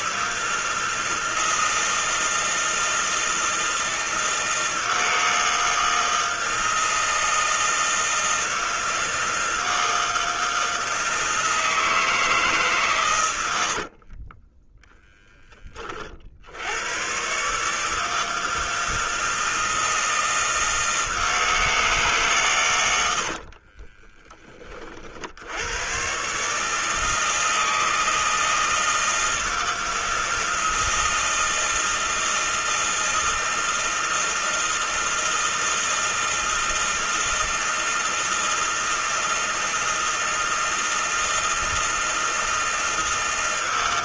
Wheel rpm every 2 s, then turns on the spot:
160, 160, 160, 160, 160, 160, 140, 10, 100, 160, 160, 90, 30, 150, 160, 160, 160, 160, 160, 160, 160, 160.
14-16 22-24